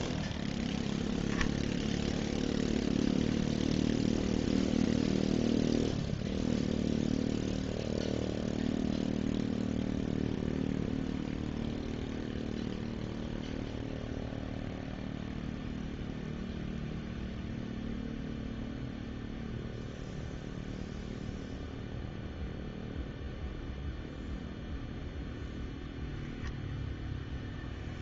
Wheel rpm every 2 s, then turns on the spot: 0, 0, 0, 0, 0, 0, 0, 0, 0, 0, 0, 0, 0, 0.
none